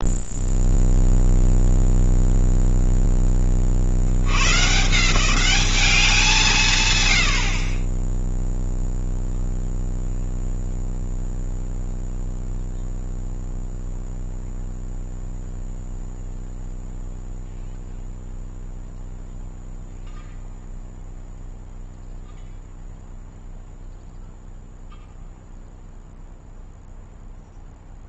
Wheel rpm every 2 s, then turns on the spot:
0, 0, 140, 130, 0, 0, 0, 0, 0, 0, 0, 0, 0, 0.
none